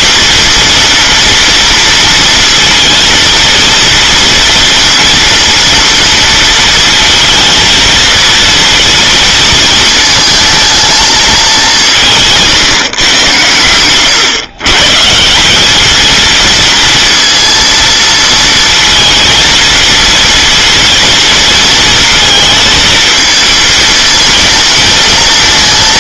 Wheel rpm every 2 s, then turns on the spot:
230, 230, 230, 230, 230, 220, 120, 150, 230, 230, 230, 230, 220.
none